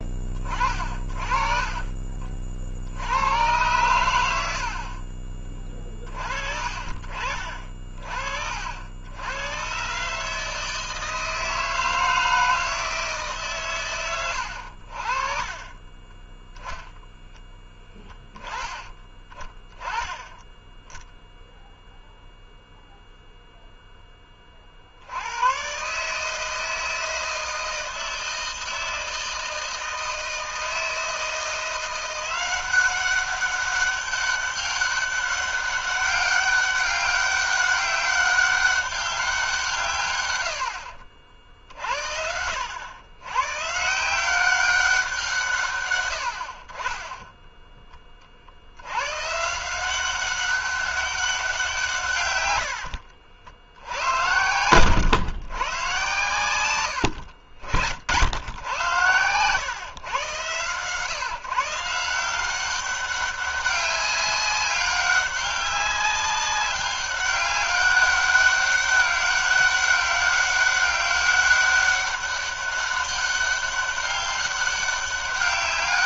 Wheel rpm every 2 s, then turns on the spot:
40, 80, 40, 40, 80, 160, 160, 60, 0, 20, 10, 0, 70, 160, 160, 160, 190, 200, 200, 200, 70, 100, 180, 20, 100, 200, 80, 120, 80, 110, 140, 200, 200, 200, 200, 200, 200, 200.
4-6 52-54